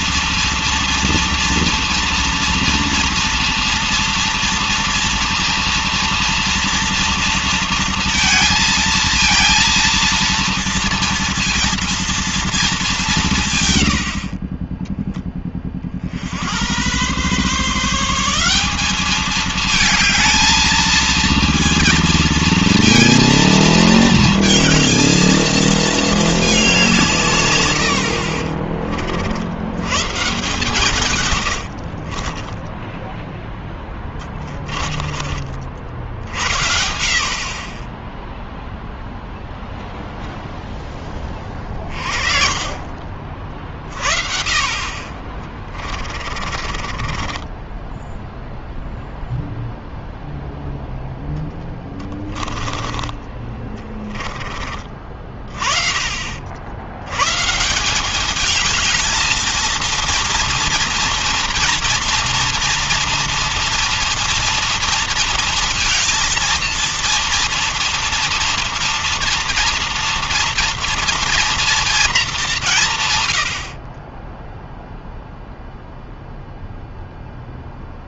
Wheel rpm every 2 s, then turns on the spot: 230, 230, 230, 230, 230, 230, 180, 20, 120, 210, 230, 230, 220, 160, 70, 130, 10, 30, 50, 0, 10, 30, 30, 20, 0, 0, 20, 30, 110, 220, 230, 240, 230, 230, 230, 230, 130, 0, 0.
30-32 46-48